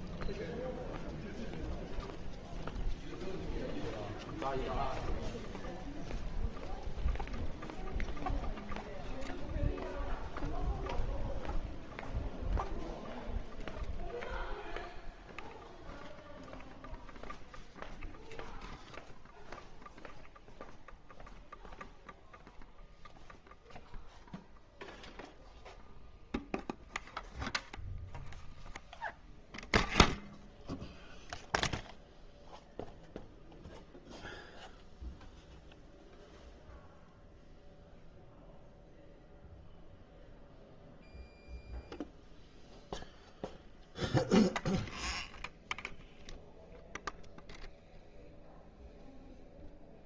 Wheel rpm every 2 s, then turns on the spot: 0, 0, 0, 0, 0, 0, 0, 0, 0, 0, 0, 0, 0, 0, 0, 0, 0, 0, 0, 0, 0, 0, 0, 0, 0.
none